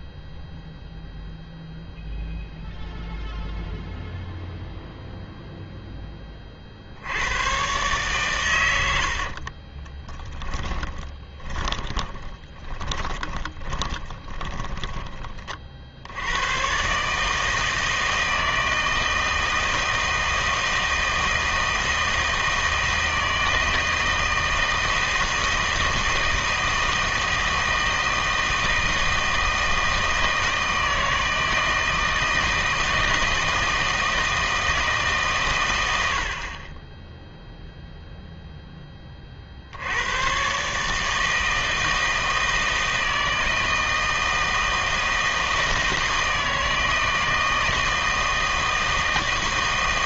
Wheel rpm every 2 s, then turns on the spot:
0, 0, 0, 50, 100, 20, 20, 20, 110, 160, 160, 160, 160, 160, 160, 160, 160, 160, 20, 10, 140, 160, 160, 160, 160.
10-16